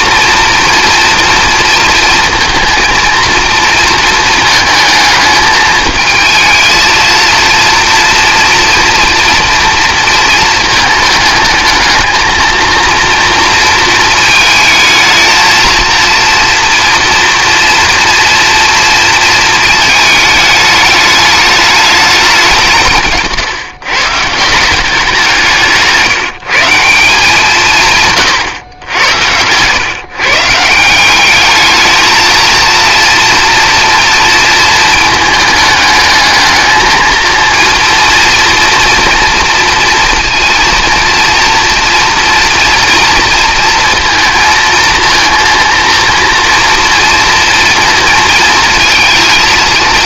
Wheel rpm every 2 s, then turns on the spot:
230, 230, 220, 220, 230, 220, 230, 220, 230, 230, 210, 170, 170, 170, 100, 160, 230, 220, 220, 230, 230, 230, 230, 230, 220.
none